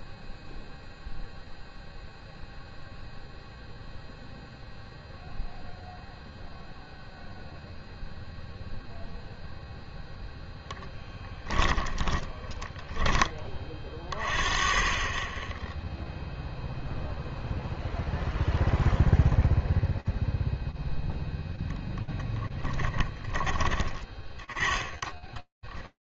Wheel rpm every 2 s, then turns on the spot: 0, 0, 0, 0, 0, 10, 30, 0, 0, 0, 10, 20, 10.
10-12 20-22 24-26